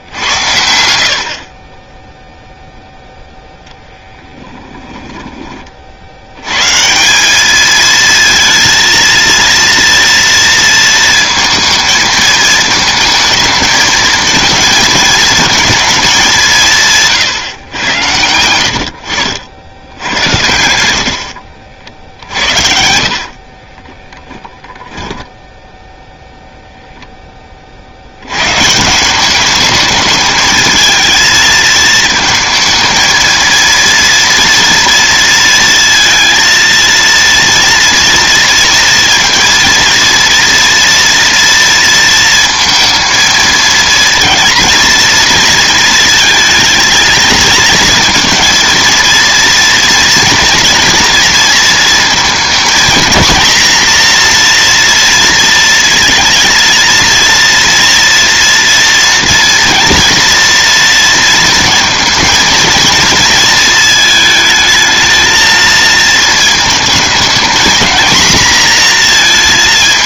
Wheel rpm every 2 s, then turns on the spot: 80, 0, 10, 150, 230, 230, 220, 220, 160, 80, 70, 60, 10, 10, 180, 220, 230, 230, 230, 230, 230, 230, 230, 230, 230, 230, 230, 230, 230, 230, 230, 230, 220, 220, 230.
4-6 16-20 22-26